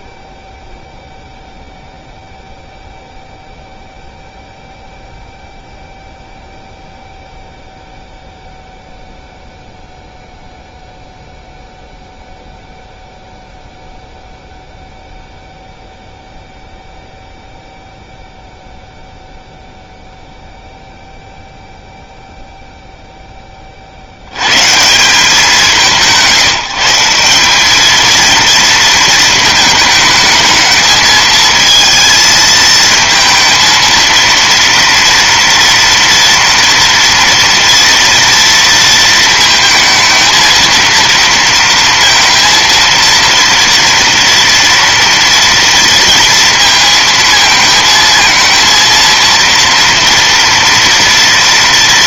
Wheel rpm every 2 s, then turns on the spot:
0, 0, 0, 0, 0, 0, 0, 0, 0, 0, 0, 30, 170, 200, 220, 220, 220, 230, 240, 220, 230, 230, 230, 220, 230, 230.
none